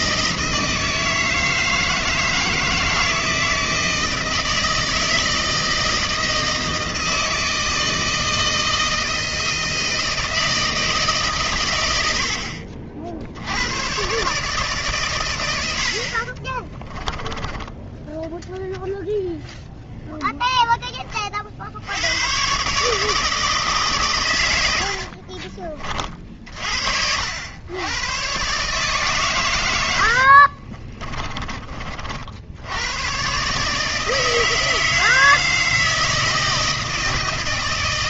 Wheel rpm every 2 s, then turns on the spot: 160, 160, 160, 160, 160, 100, 110, 80, 10, 0, 30, 160, 50, 70, 130, 30, 120, 160, 160.
16-18 24-26 30-32